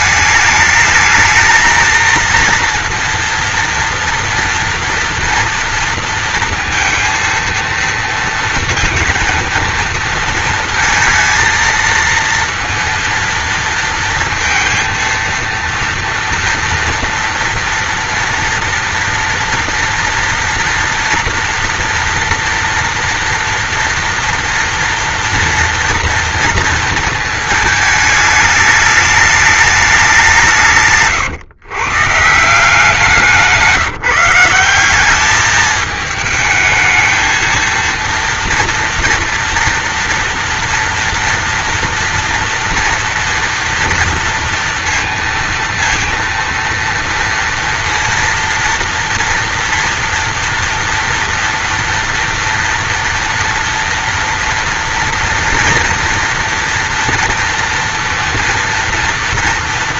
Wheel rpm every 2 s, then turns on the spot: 220, 230, 240, 230, 230, 230, 230, 230, 230, 230, 230, 230, 230, 230, 210, 140, 180, 190, 220, 230, 240, 240, 230, 230, 230, 230, 230, 230, 230, 240.
none